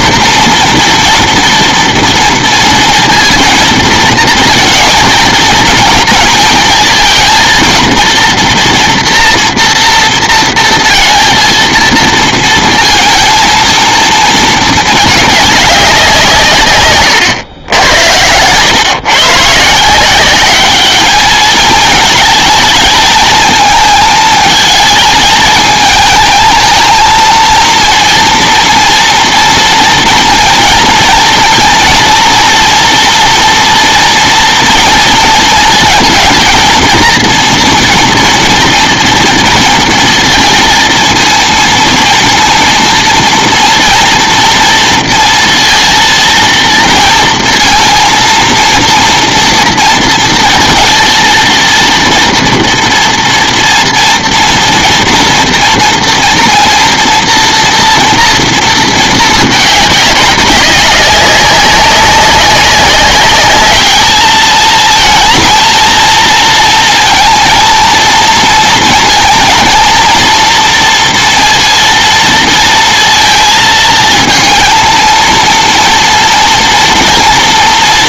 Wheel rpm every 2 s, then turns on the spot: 230, 230, 220, 230, 230, 230, 230, 220, 140, 120, 200, 220, 220, 220, 230, 230, 230, 230, 230, 230, 230, 230, 230, 230, 230, 230, 230, 230, 230, 230, 190, 190, 220, 230, 230, 230, 230, 230, 230.
none